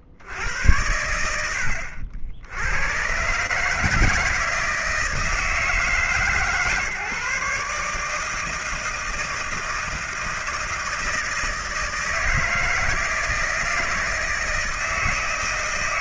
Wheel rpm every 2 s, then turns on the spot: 70, 100, 160, 150, 160, 160, 160, 160.
none